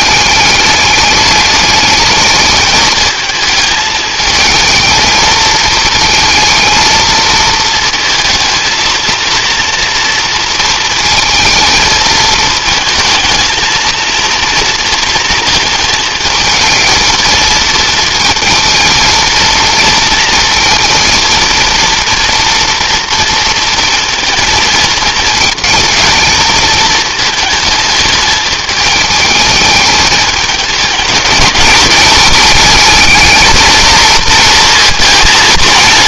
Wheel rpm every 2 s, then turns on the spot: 210, 220, 220, 220, 230, 230, 220, 230, 220, 230, 230, 230, 220, 220, 210, 220, 220, 230.
none